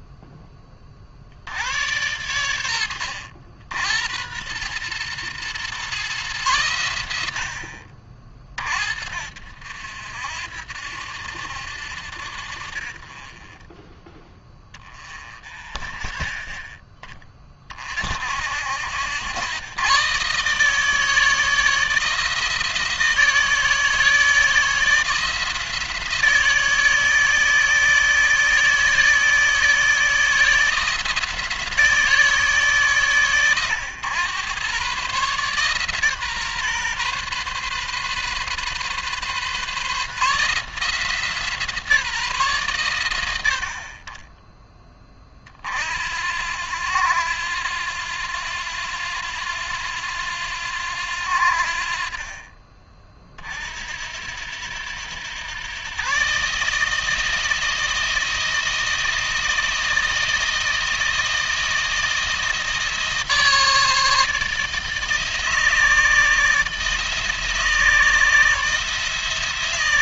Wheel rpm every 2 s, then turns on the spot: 30, 80, 110, 110, 50, 70, 40, 20, 10, 70, 150, 160, 160, 160, 160, 170, 140, 130, 130, 130, 160, 120, 20, 90, 90, 90, 30, 90, 150, 160, 160, 160, 160, 160, 160.
none